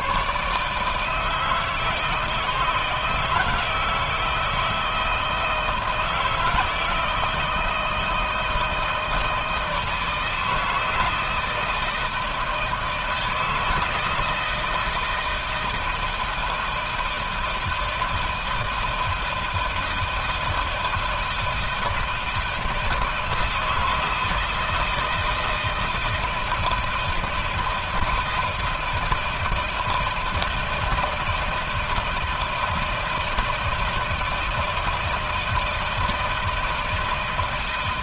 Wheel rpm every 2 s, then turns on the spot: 150, 160, 160, 160, 160, 160, 160, 160, 160, 160, 160, 160, 160, 160, 160, 170, 160, 160, 160.
none